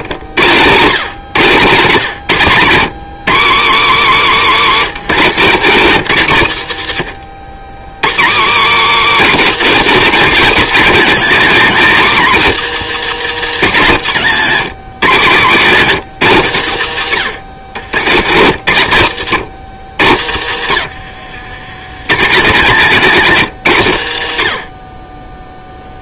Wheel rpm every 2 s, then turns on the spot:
120, 130, 150, 110, 160, 210, 180, 130, 110, 110, 90, 140, 80.
4-6 20-22